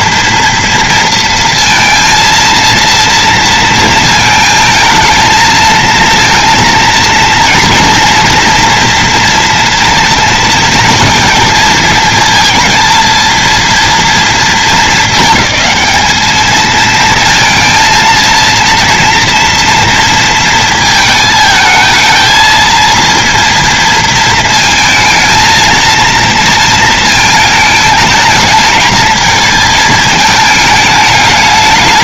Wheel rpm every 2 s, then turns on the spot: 230, 230, 230, 230, 230, 220, 230, 230, 220, 230, 230, 230, 230, 230, 220, 220.
none